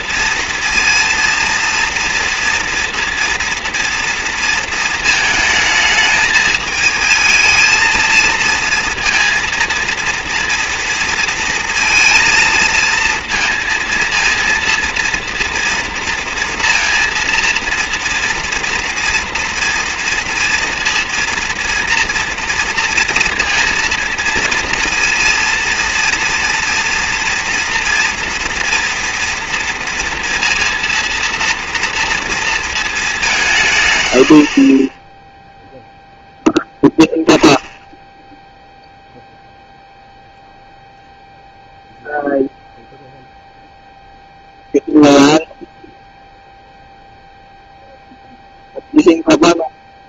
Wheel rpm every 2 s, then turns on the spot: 230, 230, 230, 220, 230, 230, 220, 230, 230, 230, 230, 230, 230, 230, 230, 230, 230, 40, 0, 0, 0, 0, 0, 0, 0.
none